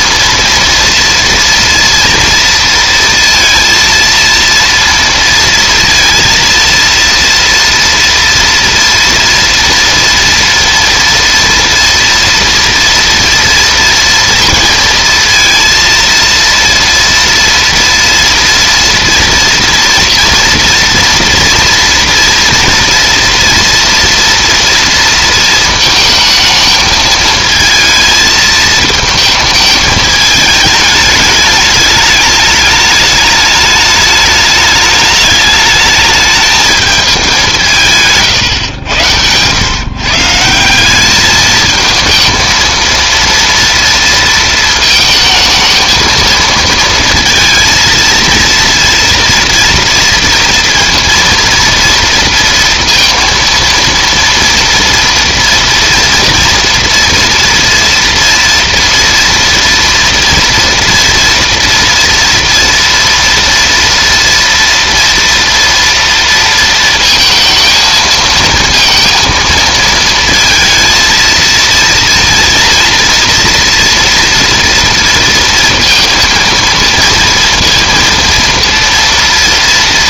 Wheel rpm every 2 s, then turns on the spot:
230, 230, 230, 230, 230, 230, 230, 230, 230, 230, 230, 230, 230, 220, 220, 220, 210, 210, 220, 110, 170, 230, 230, 230, 230, 230, 230, 230, 230, 230, 230, 230, 240, 230, 230, 230, 230, 230, 230, 230.
none